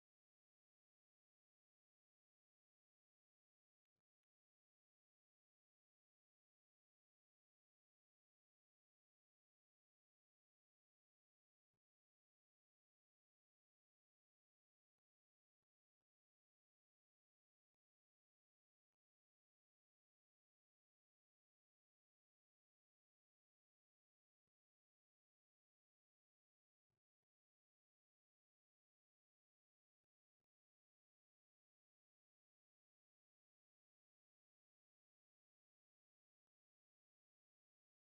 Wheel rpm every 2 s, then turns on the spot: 0, 0, 0, 0, 0, 0, 0, 0, 0, 0, 0, 0, 0, 0, 0, 0, 0, 0, 0.
none